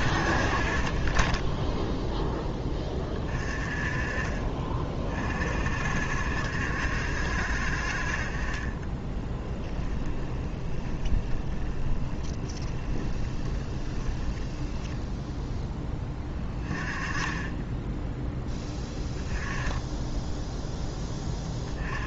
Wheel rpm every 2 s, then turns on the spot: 40, 10, 40, 60, 20, 10, 10, 10, 20, 10, 10.
10-16